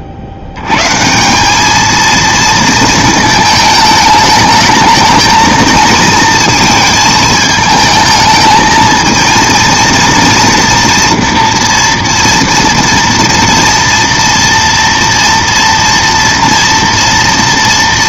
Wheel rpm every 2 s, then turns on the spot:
100, 230, 220, 220, 220, 230, 230, 230, 230.
none